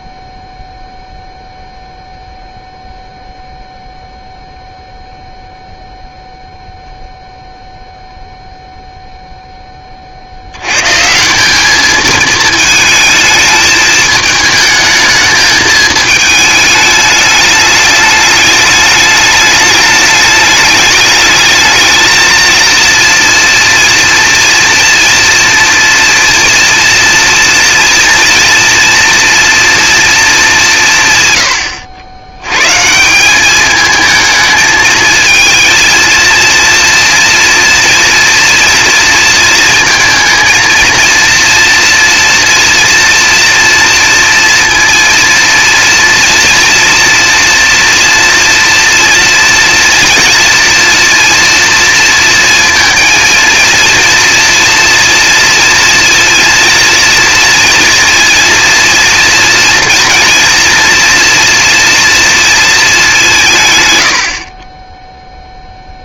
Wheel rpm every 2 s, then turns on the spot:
0, 0, 0, 0, 0, 100, 220, 220, 220, 210, 210, 230, 230, 230, 230, 210, 120, 220, 230, 240, 230, 230, 230, 230, 240, 240, 230, 230, 230, 230, 230, 230, 40.
none